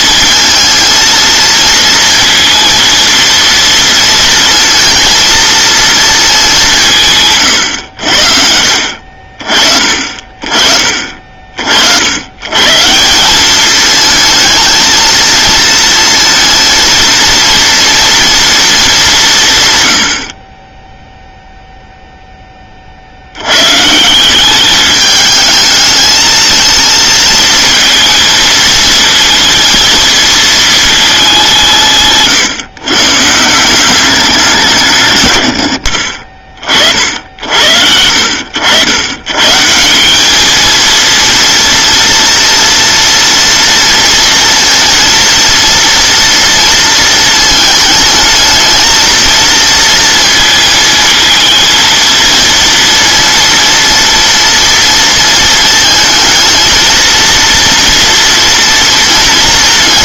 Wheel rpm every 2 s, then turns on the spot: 230, 230, 230, 160, 60, 40, 150, 230, 230, 220, 20, 30, 200, 220, 230, 220, 140, 170, 40, 80, 220, 230, 230, 230, 220, 230, 230, 230, 230, 230.
none